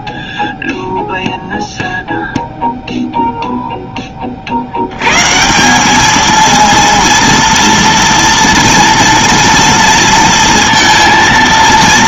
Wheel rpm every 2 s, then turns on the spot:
0, 30, 220, 230, 230, 210.
none